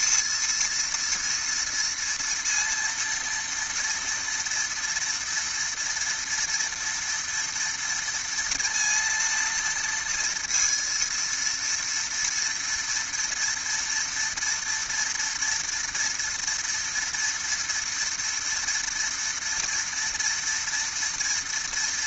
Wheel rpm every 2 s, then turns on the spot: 230, 230, 230, 240, 230, 230, 230, 230, 230, 230, 230.
none